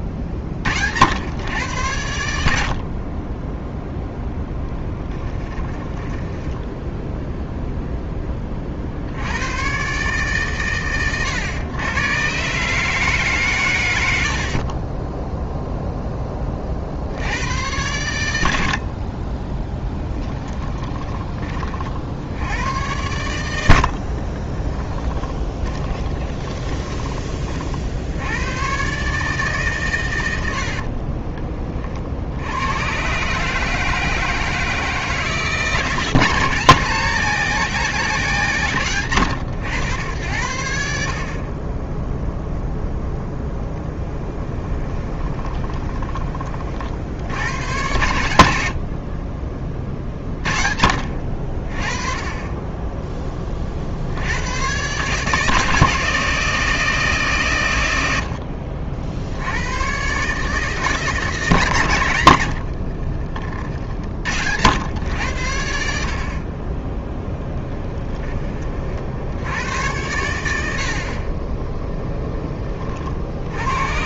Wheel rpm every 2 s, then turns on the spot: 50, 60, 10, 10, 50, 130, 150, 40, 40, 30, 20, 100, 20, 20, 110, 70, 100, 160, 180, 120, 70, 0, 10, 40, 70, 50, 20, 110, 160, 60, 150, 70, 90, 20, 40, 70, 30.
4-8 20-22 24-28 30-32 44-46 62-64